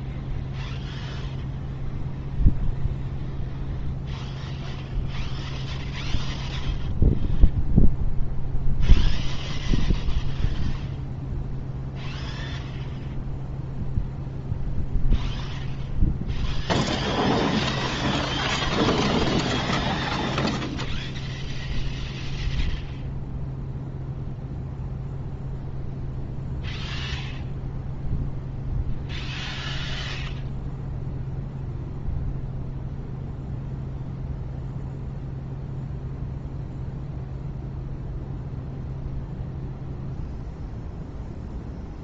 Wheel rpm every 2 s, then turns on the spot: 0, 0, 0, 0, 0, 0, 0, 0, 0, 0, 0, 0, 0, 0, 0, 0, 0, 0, 0, 0, 0.
none